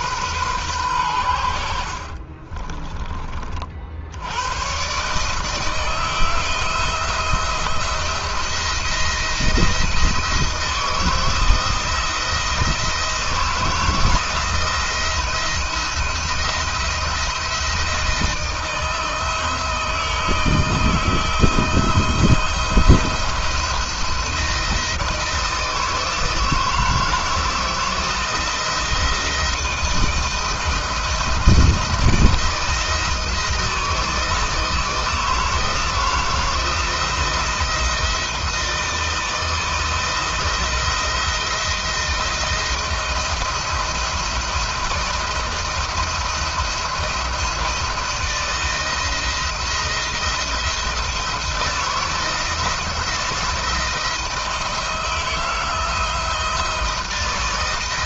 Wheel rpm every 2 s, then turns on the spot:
110, 30, 120, 160, 170, 160, 160, 170, 170, 160, 160, 170, 160, 160, 170, 160, 160, 160, 160, 160, 160, 160, 170, 170, 160, 160, 170, 160, 170.
2-4